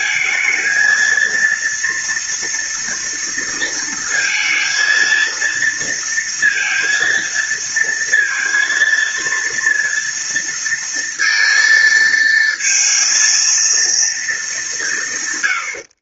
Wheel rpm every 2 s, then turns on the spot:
230, 230, 230, 230, 230, 230, 230, 190.
none